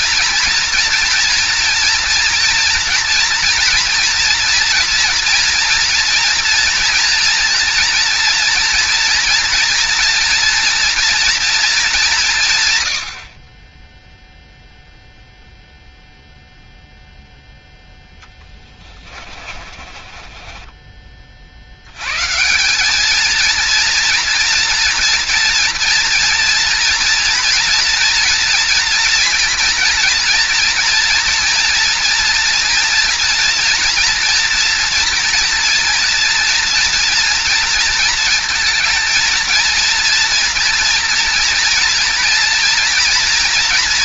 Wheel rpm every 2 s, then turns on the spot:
230, 240, 240, 230, 240, 240, 140, 0, 0, 20, 40, 220, 230, 230, 230, 230, 230, 230, 230, 230, 230, 230.
18-20